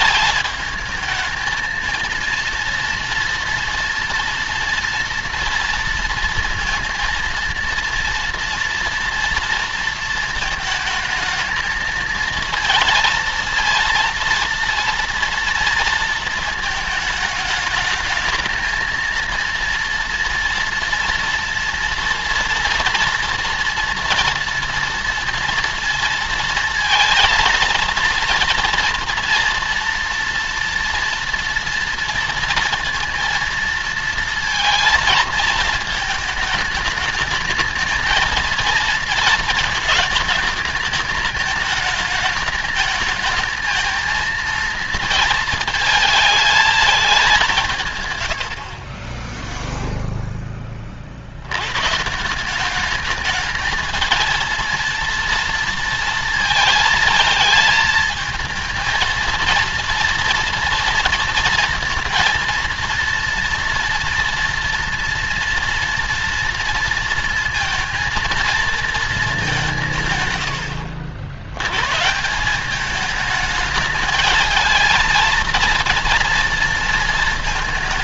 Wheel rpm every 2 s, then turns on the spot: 220, 230, 240, 230, 230, 220, 230, 230, 220, 220, 230, 230, 230, 230, 230, 230, 230, 230, 220, 230, 220, 220, 230, 220, 80, 10, 180, 230, 230, 220, 230, 230, 230, 230, 230, 120, 180, 220, 230.
none